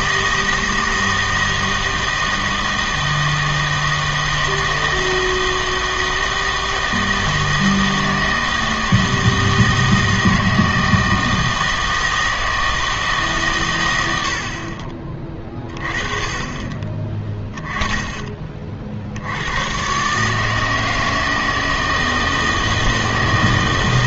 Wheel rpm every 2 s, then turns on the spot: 160, 160, 160, 160, 160, 160, 160, 70, 30, 40, 160, 160.
none